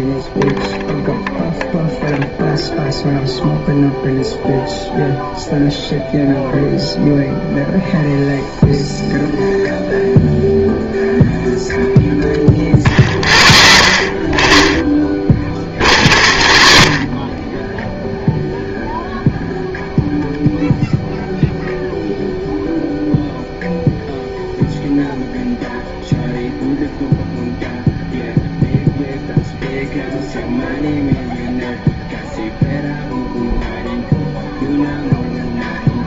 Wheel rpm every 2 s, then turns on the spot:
0, 0, 0, 0, 0, 0, 0, 0, 0, 0, 0, 0, 0, 0, 0, 0, 0, 0.
none